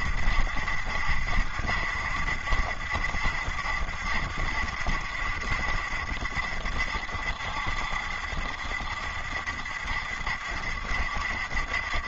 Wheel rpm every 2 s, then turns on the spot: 70, 70, 70, 70, 70, 70.
none